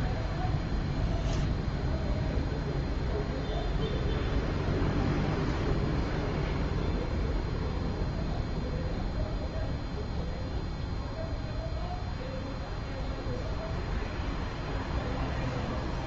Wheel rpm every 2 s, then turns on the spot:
0, 0, 0, 0, 0, 0, 0, 0.
none